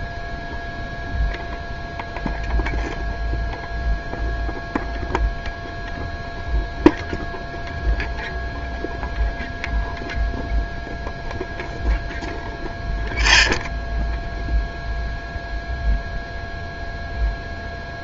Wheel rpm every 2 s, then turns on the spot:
0, 0, 0, 0, 0, 0, 0, 0, 0.
none